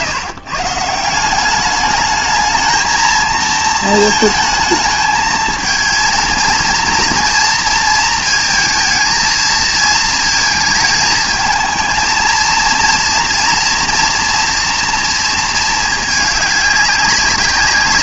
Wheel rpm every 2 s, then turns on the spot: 150, 220, 220, 230, 220, 220, 230, 240, 200.
none